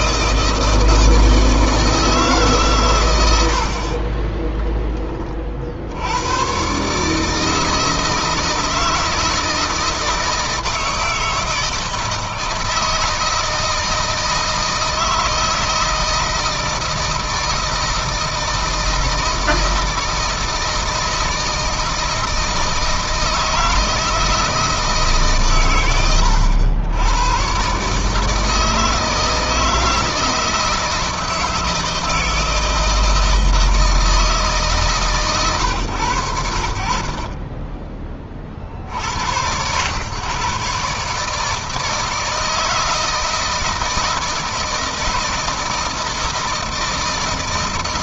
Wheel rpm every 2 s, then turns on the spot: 160, 140, 20, 130, 160, 160, 160, 160, 160, 160, 160, 160, 160, 90, 160, 160, 160, 150, 70, 50, 130, 160, 160, 160.
4-6